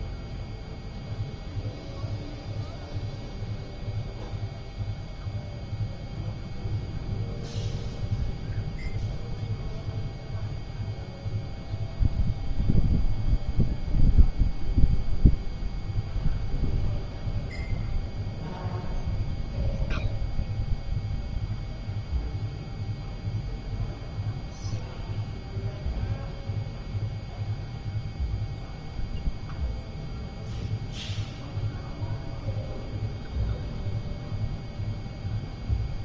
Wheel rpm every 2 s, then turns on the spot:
0, 0, 0, 0, 0, 0, 0, 0, 0, 0, 0, 0, 0, 0, 0, 0, 0, 0.
none